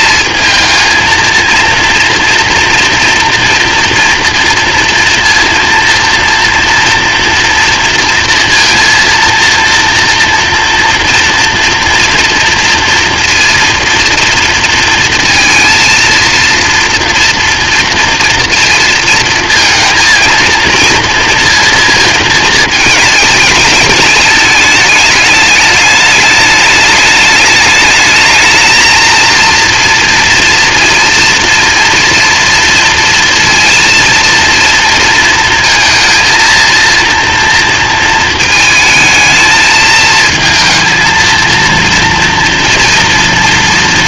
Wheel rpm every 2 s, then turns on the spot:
230, 230, 230, 230, 230, 230, 230, 230, 230, 230, 230, 220, 210, 210, 220, 230, 230, 230, 230, 220, 230, 230.
none